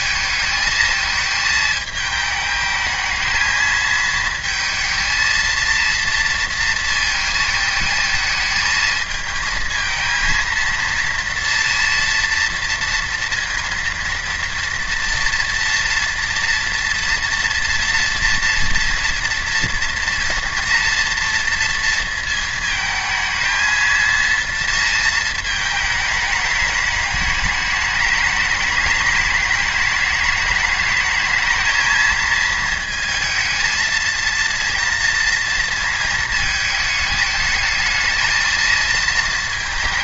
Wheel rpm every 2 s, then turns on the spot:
220, 220, 230, 230, 220, 230, 230, 230, 230, 230, 230, 220, 230, 210, 210, 210, 220, 230, 220, 220.
none